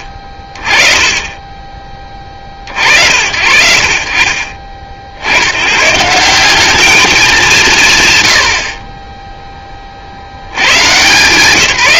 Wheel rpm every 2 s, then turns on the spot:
30, 60, 40, 210, 70, 130.
none